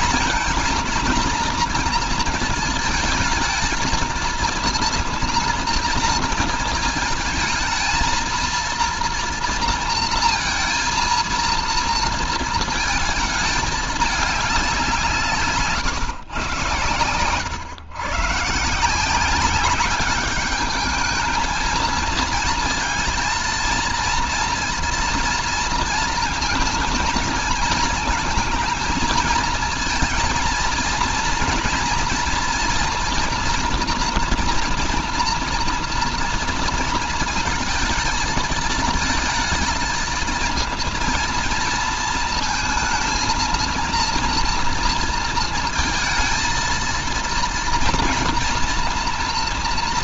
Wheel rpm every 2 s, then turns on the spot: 220, 220, 230, 230, 230, 230, 230, 190, 120, 160, 210, 230, 230, 230, 220, 230, 230, 230, 230, 220, 230, 230, 230, 230, 230.
none